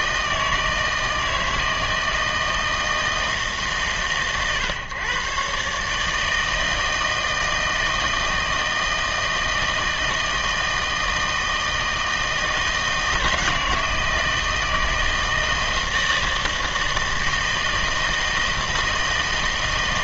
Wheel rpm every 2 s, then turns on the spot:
160, 160, 130, 160, 160, 160, 160, 160, 160, 160.
none